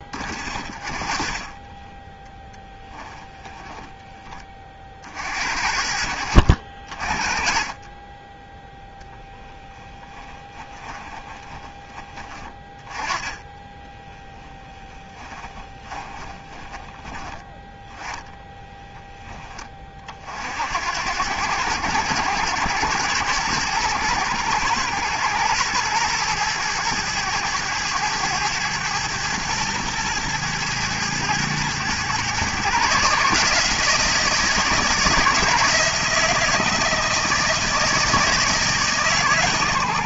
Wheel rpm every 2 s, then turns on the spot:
30, 10, 30, 50, 0, 20, 20, 20, 20, 10, 70, 100, 110, 110, 110, 110, 130, 160, 160, 150.
2-4 10-16